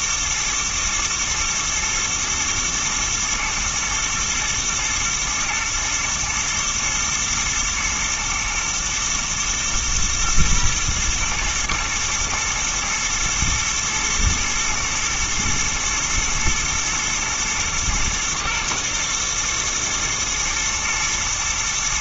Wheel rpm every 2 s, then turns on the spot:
110, 120, 120, 110, 110, 120, 110, 110, 110, 120, 120.
none